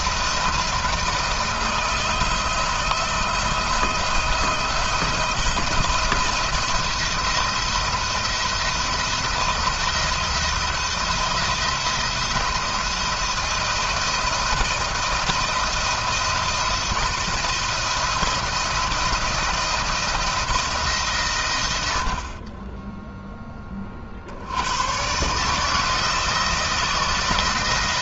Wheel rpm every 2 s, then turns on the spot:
160, 160, 170, 170, 170, 170, 160, 160, 170, 170, 150, 20, 110, 160.
none